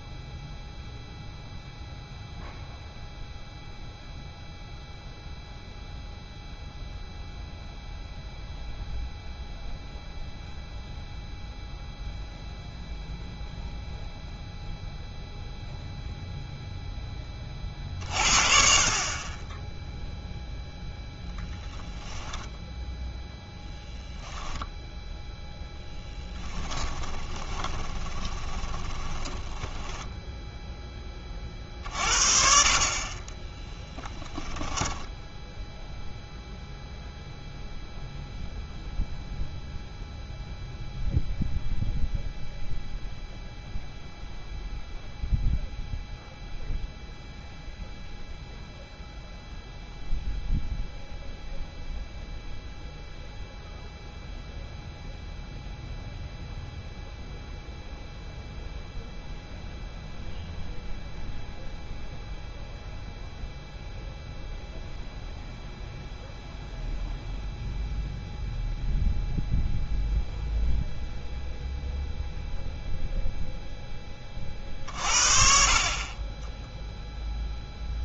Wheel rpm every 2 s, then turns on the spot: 0, 0, 0, 0, 0, 0, 0, 0, 0, 40, 0, 10, 0, 20, 10, 10, 40, 10, 0, 0, 0, 0, 0, 0, 0, 0, 0, 0, 0, 0, 0, 0, 0, 0, 0, 0, 0, 50, 10.
26-30 34-36 76-78